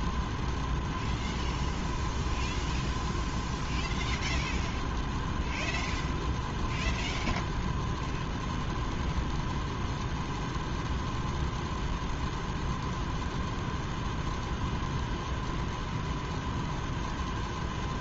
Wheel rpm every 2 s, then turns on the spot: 0, 0, 0, 0, 0, 0, 0, 0, 0.
none